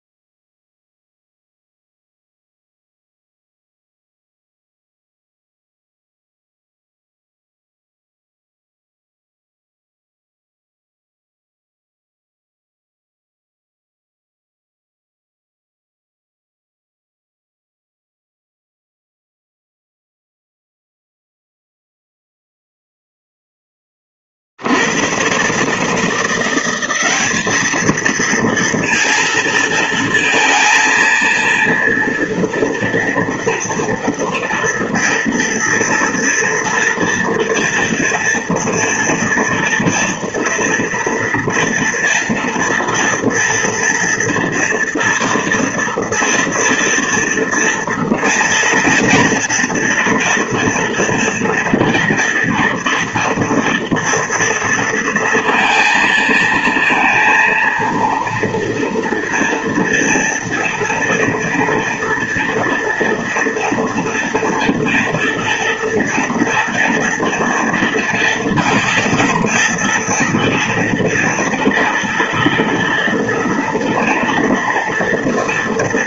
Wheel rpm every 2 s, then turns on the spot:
0, 0, 0, 0, 0, 0, 0, 0, 0, 0, 0, 0, 80, 180, 230, 230, 230, 230, 230, 230, 230, 230, 230, 230, 230, 230, 230, 230, 230, 230, 230, 230, 230, 240, 230, 230, 230, 230.
none